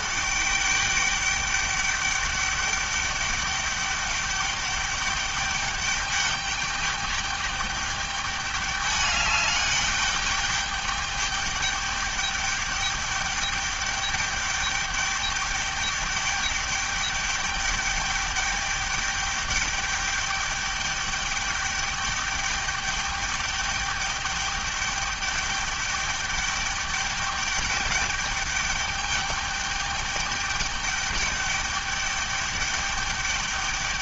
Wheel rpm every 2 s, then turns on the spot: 200, 200, 200, 210, 210, 210, 210, 210, 210, 210, 210, 210, 210, 210, 210, 210, 210.
none